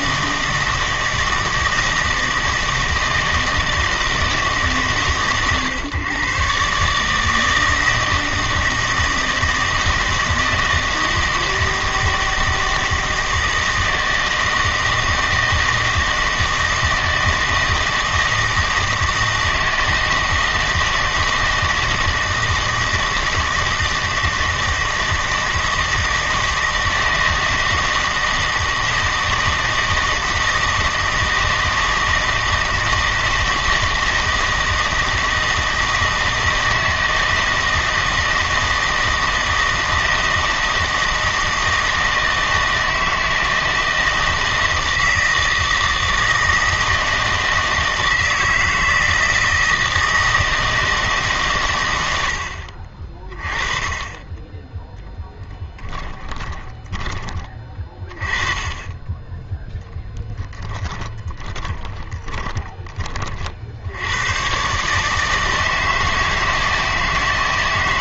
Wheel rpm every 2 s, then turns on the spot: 160, 160, 150, 140, 160, 160, 160, 160, 160, 160, 160, 160, 160, 160, 160, 160, 160, 160, 160, 160, 160, 160, 160, 160, 160, 160, 60, 10, 10, 20, 10, 20, 130, 160.
56-58 60-62